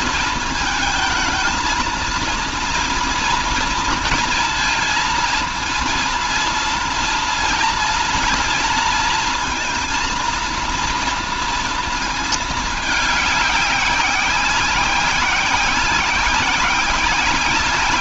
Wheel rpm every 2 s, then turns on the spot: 220, 230, 230, 230, 230, 230, 210, 190, 180.
none